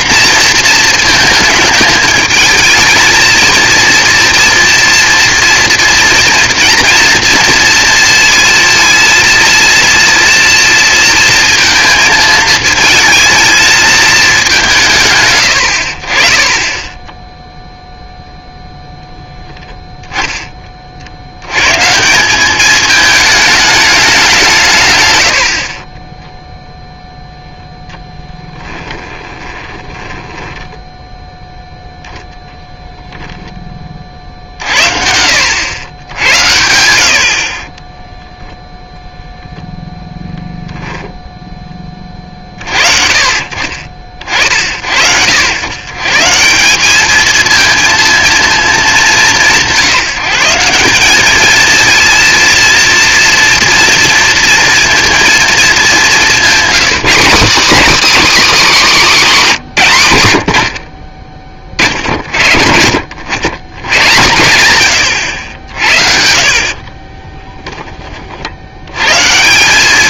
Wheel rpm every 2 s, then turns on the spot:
240, 220, 230, 230, 230, 230, 220, 190, 20, 0, 20, 200, 150, 0, 10, 10, 10, 60, 90, 0, 0, 40, 60, 190, 220, 170, 230, 230, 210, 260, 80, 60, 110, 50, 70.
28-30 66-68